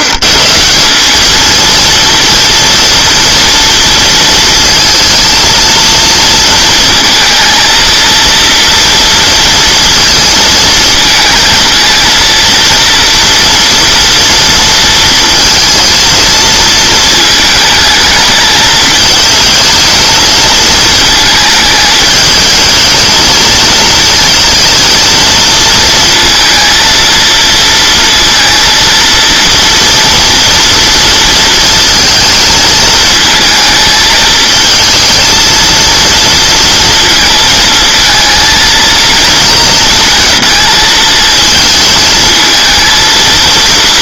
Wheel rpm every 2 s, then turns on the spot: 170, 230, 230, 230, 230, 230, 230, 230, 230, 220, 220, 220, 230, 230, 230, 230, 220, 230, 230, 230, 230, 220.
none